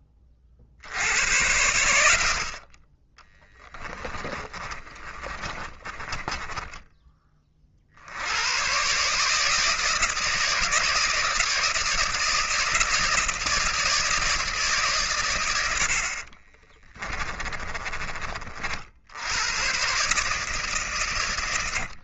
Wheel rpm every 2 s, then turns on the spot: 50, 30, 30, 20, 130, 160, 160, 140, 20, 60, 130.
4-6 16-18